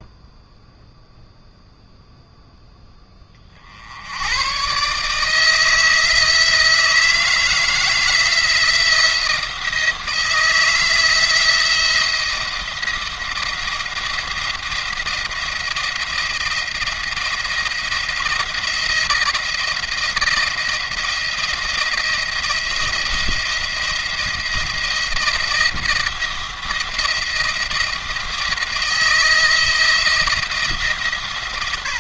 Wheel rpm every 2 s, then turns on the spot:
0, 10, 120, 160, 160, 160, 170, 170, 170, 170, 170, 170, 170, 170, 170, 150.
none